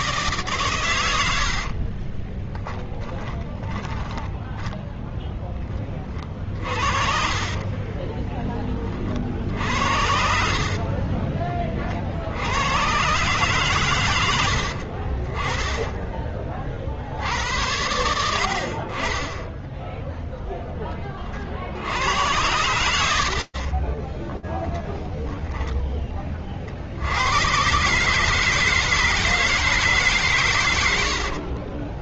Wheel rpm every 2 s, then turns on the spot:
130, 20, 10, 40, 30, 40, 90, 80, 50, 40, 10, 80, 10, 60, 160, 100.
2-8 10-12 14-16